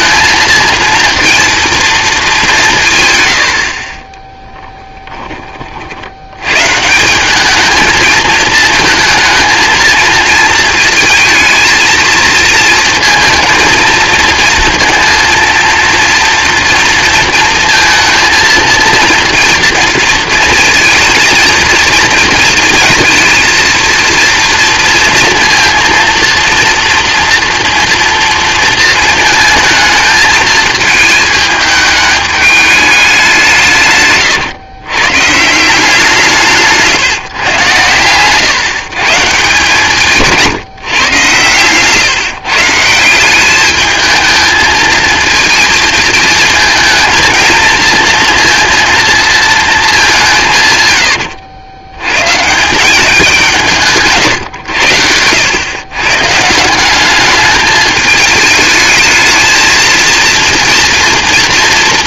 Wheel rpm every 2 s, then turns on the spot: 230, 160, 20, 170, 220, 230, 230, 230, 230, 230, 230, 230, 230, 230, 230, 220, 200, 130, 170, 150, 140, 170, 220, 220, 230, 90, 190, 100, 190, 220, 230.
50-52